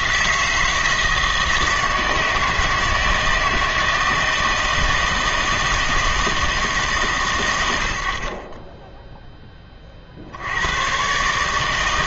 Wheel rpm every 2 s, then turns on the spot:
160, 160, 160, 150, 10, 110.
none